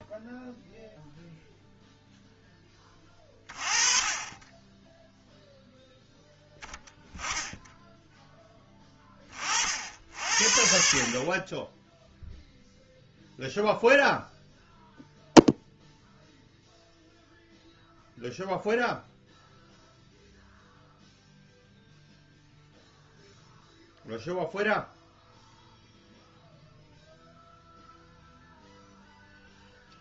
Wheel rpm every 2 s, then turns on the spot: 0, 10, 20, 20, 10, 60, 0, 0, 0, 0, 0, 0, 0, 0, 0.
none